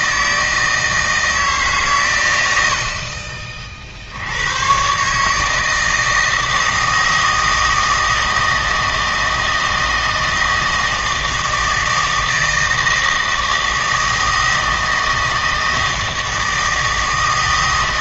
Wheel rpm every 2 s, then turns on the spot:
160, 80, 120, 160, 160, 160, 160, 160, 160.
none